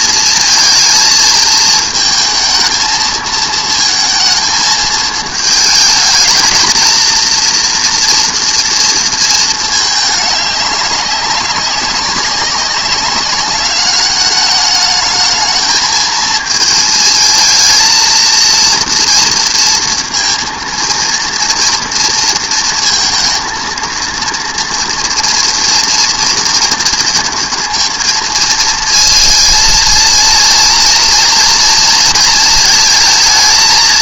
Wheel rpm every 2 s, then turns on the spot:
220, 220, 220, 230, 230, 200, 200, 210, 220, 230, 230, 230, 230, 230, 230, 230, 230.
none